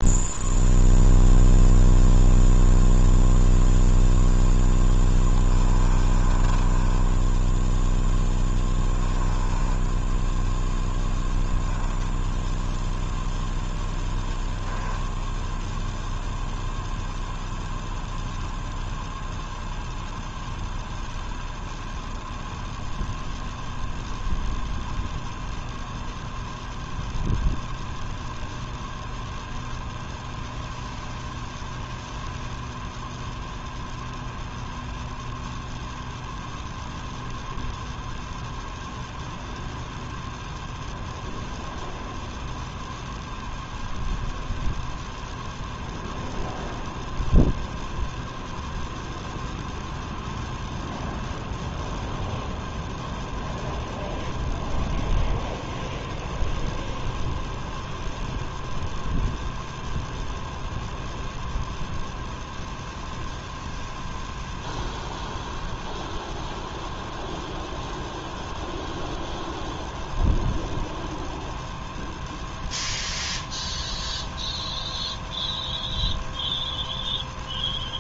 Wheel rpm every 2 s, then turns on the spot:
0, 0, 10, 20, 10, 0, 0, 10, 0, 0, 0, 0, 0, 0, 0, 0, 0, 0, 0, 0, 0, 0, 0, 0, 0, 0, 0, 0, 0, 0, 0, 0, 0, 0, 0, 0, 0, 0, 0.
4-10 14-16